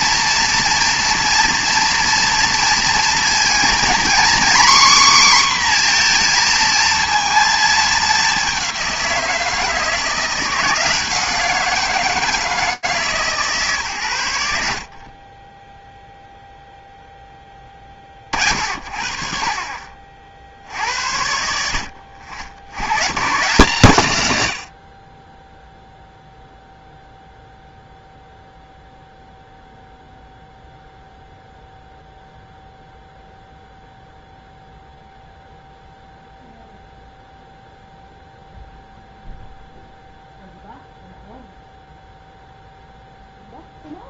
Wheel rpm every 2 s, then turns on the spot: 230, 230, 260, 230, 190, 170, 160, 60, 0, 40, 60, 70, 90, 0, 0, 0, 0, 0, 0, 0, 0, 0.
none